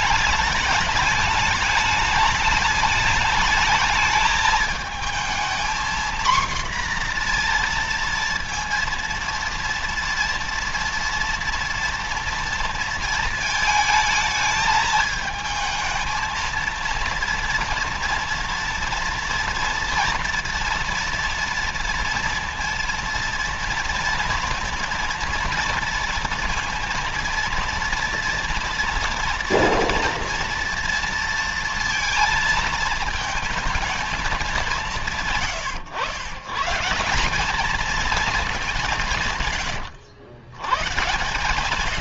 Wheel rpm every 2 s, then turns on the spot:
210, 210, 210, 240, 230, 230, 230, 220, 230, 230, 230, 230, 230, 230, 230, 230, 230, 190, 140, 200, 110.
none